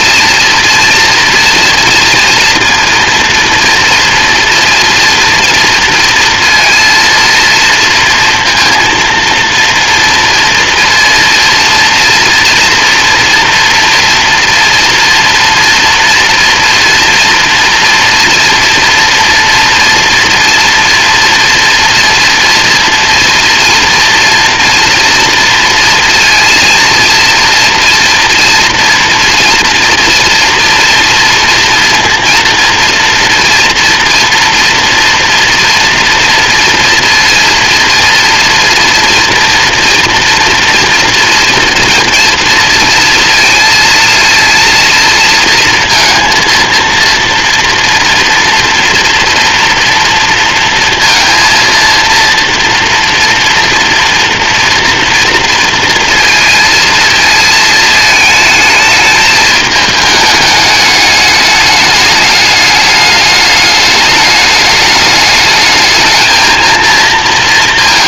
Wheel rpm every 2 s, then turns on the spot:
230, 230, 230, 230, 230, 230, 230, 230, 230, 230, 230, 230, 230, 230, 230, 230, 240, 240, 240, 240, 230, 230, 230, 230, 230, 230, 230, 230, 220, 220, 210, 210, 210, 230.
none